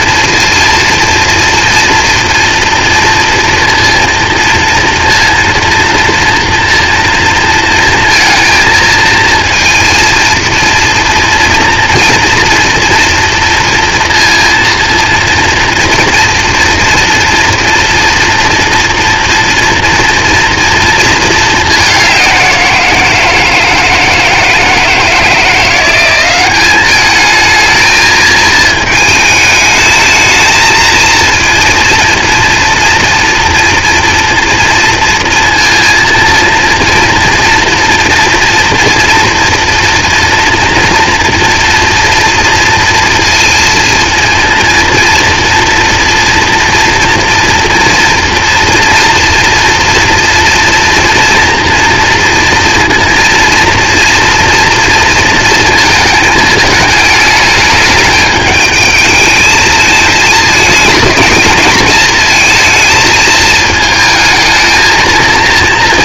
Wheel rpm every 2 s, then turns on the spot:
230, 230, 230, 240, 230, 230, 230, 230, 230, 240, 230, 170, 160, 200, 220, 220, 230, 230, 230, 230, 240, 230, 230, 230, 230, 230, 230, 230, 220, 210, 220, 220, 220.
none